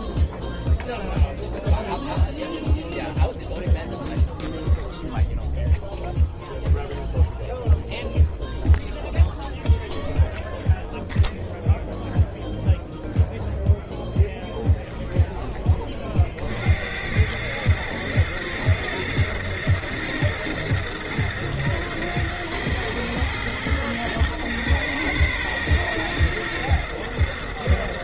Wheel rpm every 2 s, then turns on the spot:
0, 0, 0, 0, 0, 0, 0, 10, 60, 110, 120, 110, 110, 110.
14-16